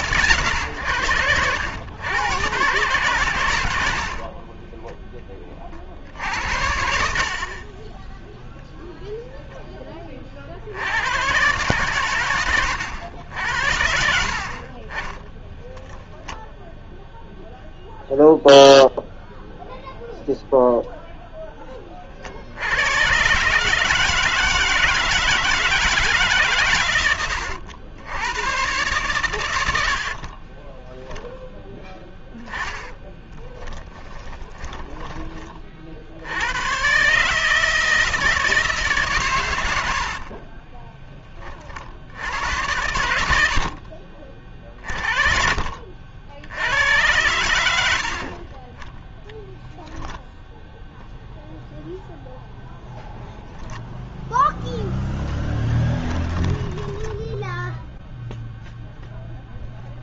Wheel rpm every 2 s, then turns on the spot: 110, 120, 20, 70, 0, 70, 110, 50, 0, 0, 0, 70, 160, 140, 110, 30, 10, 20, 100, 160, 30, 80, 40, 70, 50, 0, 0, 10, 10, 0.
4-6 14-16 30-36 40-44 56-58